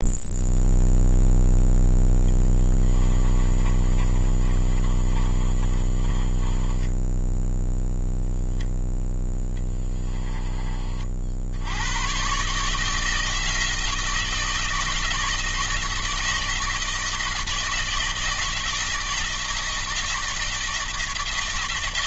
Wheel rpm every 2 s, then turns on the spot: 0, 20, 30, 10, 0, 40, 160, 160, 160, 160, 160.
2-8